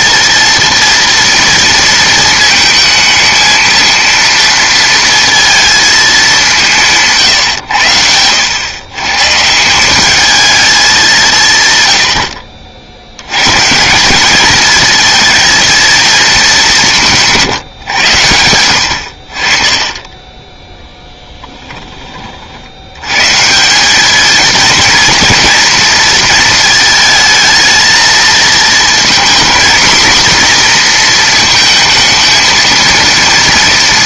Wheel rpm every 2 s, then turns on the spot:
230, 220, 230, 190, 110, 210, 60, 220, 210, 100, 10, 60, 230, 220, 220, 240, 230.
none